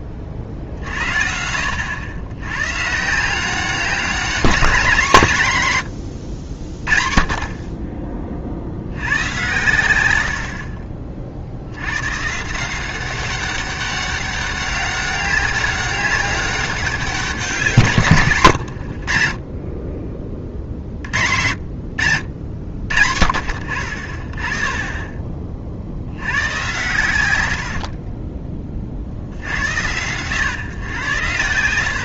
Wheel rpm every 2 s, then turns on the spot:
40, 130, 190, 50, 60, 50, 170, 200, 190, 100, 50, 70, 30, 100, 40, 110.
none